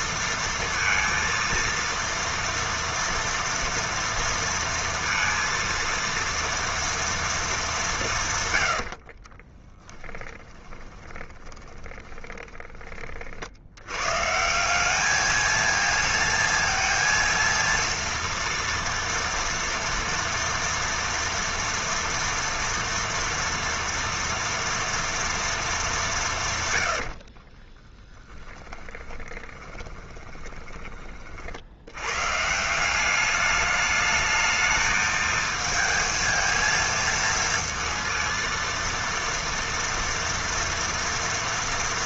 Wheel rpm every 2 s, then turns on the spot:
230, 230, 230, 230, 110, 10, 20, 190, 230, 230, 230, 230, 240, 110, 20, 20, 170, 220, 230, 230, 230.
8-12 26-30